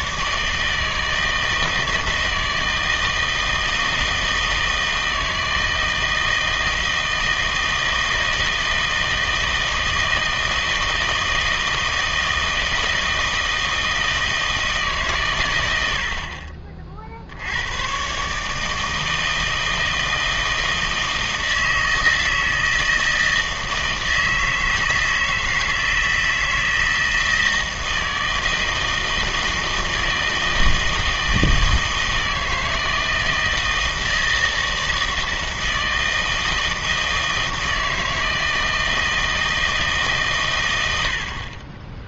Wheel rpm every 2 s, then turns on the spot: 160, 160, 160, 160, 160, 160, 160, 150, 40, 160, 160, 160, 160, 160, 160, 160, 160, 160, 160, 160, 110.
none